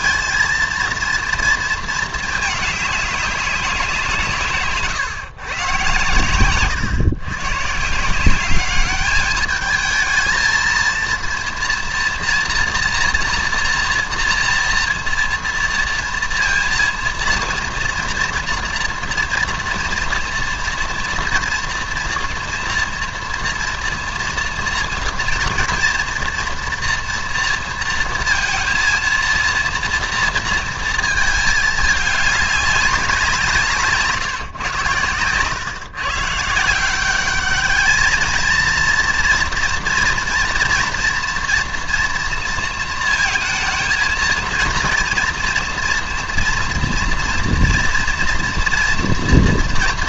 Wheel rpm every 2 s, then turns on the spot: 230, 210, 130, 120, 200, 220, 230, 240, 230, 240, 230, 230, 230, 230, 230, 230, 210, 130, 160, 230, 240, 230, 230, 230, 240.
none